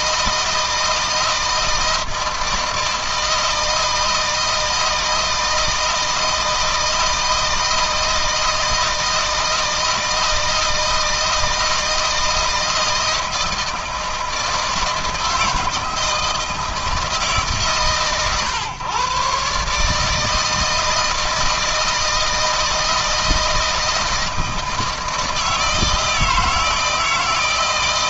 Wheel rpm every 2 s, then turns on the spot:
160, 160, 160, 160, 160, 160, 160, 160, 160, 120, 160, 160, 160, 160.
none